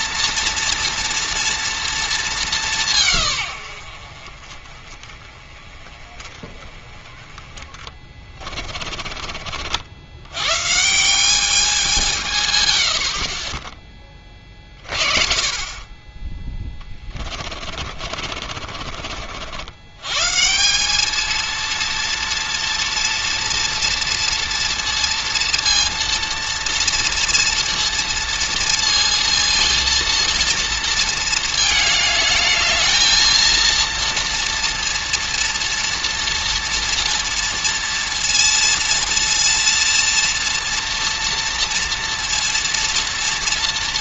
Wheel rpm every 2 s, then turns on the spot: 230, 170, 30, 30, 30, 140, 100, 30, 20, 50, 190, 230, 230, 230, 230, 230, 220, 230, 230, 230, 230, 230.
8-10 16-20